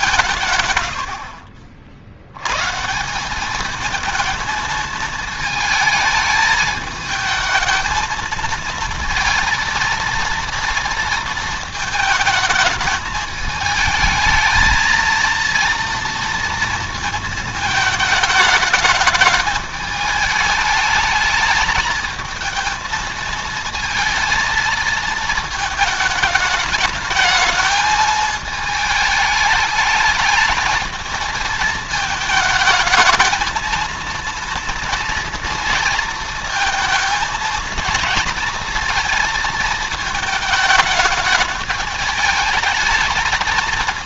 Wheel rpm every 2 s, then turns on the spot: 100, 150, 220, 220, 230, 230, 220, 220, 230, 210, 220, 220, 220, 210, 220, 220, 220, 230, 230, 230, 210, 220.
none